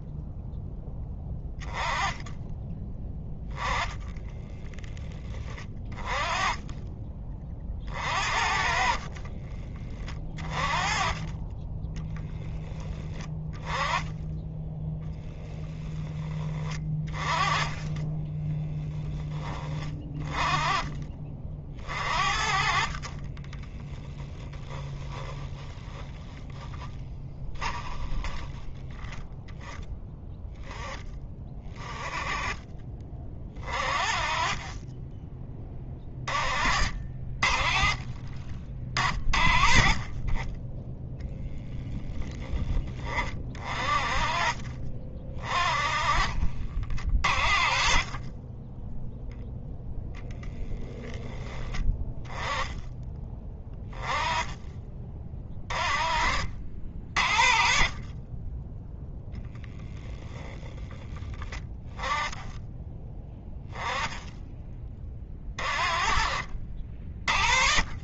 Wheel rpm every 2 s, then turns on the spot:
10, 10, 20, 30, 30, 30, 10, 20, 30, 20, 30, 30, 10, 10, 10, 10, 20, 30, 40, 40, 10, 20, 40, 50, 10, 10, 10, 30, 50, 10, 30, 10, 30, 50.
8-10 16-20 22-26